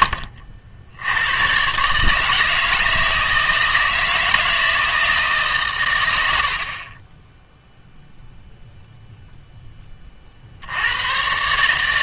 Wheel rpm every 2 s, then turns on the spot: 50, 160, 160, 60, 0, 80.
none